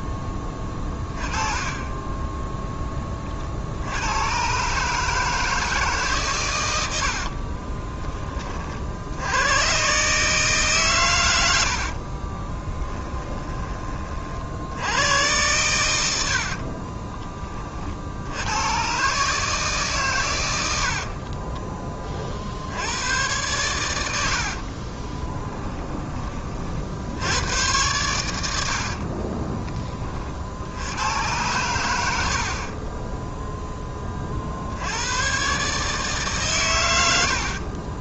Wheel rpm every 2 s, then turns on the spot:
20, 20, 150, 80, 60, 130, 20, 90, 40, 120, 70, 90, 30, 70, 50, 90, 30, 90, 100.
6-8 12-14 16-18 20-22 24-26 28-30 32-34